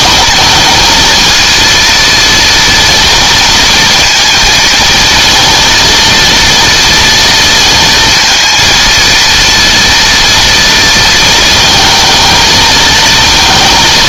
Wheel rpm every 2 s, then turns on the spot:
220, 230, 230, 230, 230, 230, 220.
none